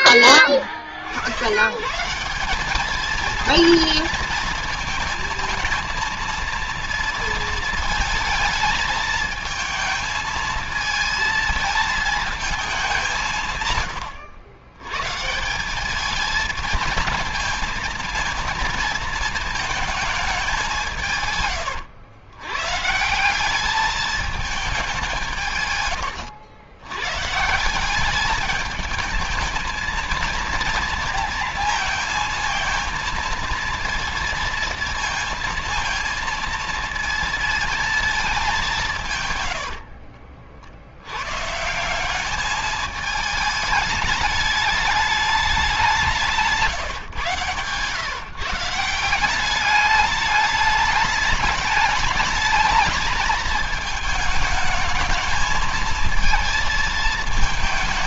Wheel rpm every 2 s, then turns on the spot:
30, 190, 230, 230, 220, 220, 220, 110, 220, 230, 190, 120, 210, 80, 210, 230, 230, 230, 230, 200, 60, 210, 210, 160, 150, 210, 220, 220, 220.
46-48